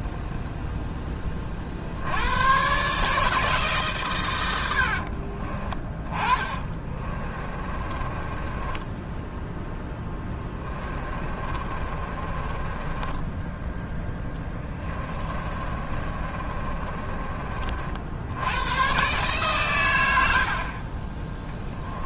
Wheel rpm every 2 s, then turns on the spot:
10, 140, 70, 30, 10, 20, 20, 20, 30, 120, 30.
4-18